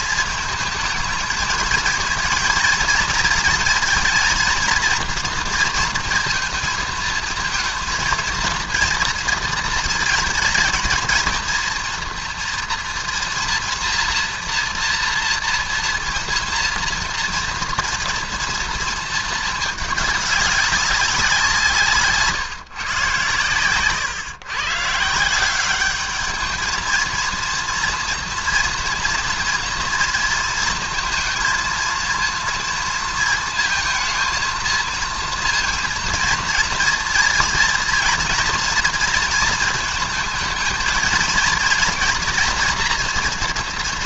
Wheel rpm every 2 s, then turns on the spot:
220, 230, 230, 220, 220, 220, 230, 230, 230, 230, 210, 150, 130, 210, 230, 230, 230, 220, 230, 230, 220, 230.
none